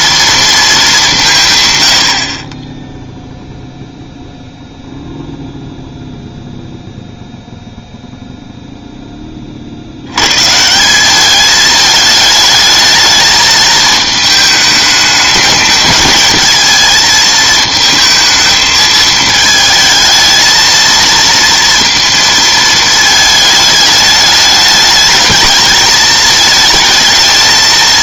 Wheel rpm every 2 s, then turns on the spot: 230, 20, 0, 0, 0, 140, 220, 210, 220, 220, 220, 230, 210, 220.
none